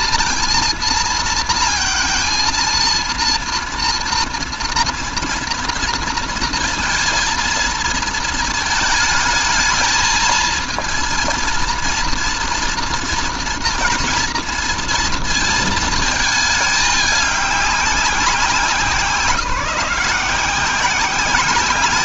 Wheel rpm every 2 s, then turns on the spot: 230, 230, 230, 230, 220, 230, 230, 230, 210, 180, 180.
none